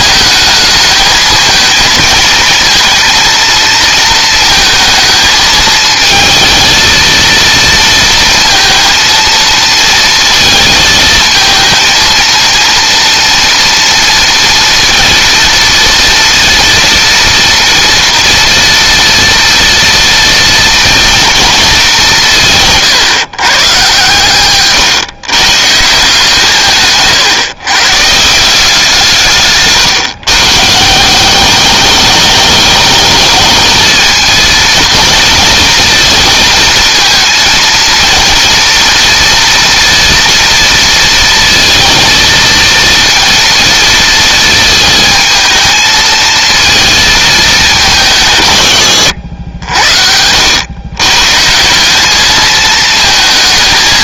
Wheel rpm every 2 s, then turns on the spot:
220, 230, 220, 220, 230, 220, 230, 230, 230, 230, 230, 140, 130, 150, 170, 150, 210, 230, 230, 230, 230, 230, 220, 230, 110, 110, 220.
22-24